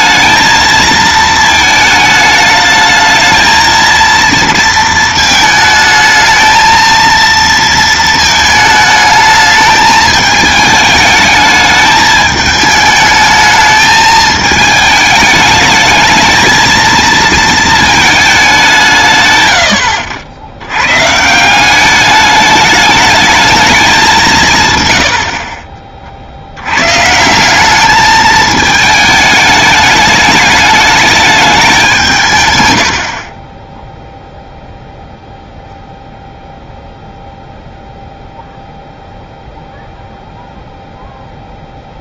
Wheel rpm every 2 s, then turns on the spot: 220, 220, 230, 230, 220, 210, 210, 220, 230, 180, 110, 210, 120, 110, 220, 210, 100, 0, 0, 0, 0.
none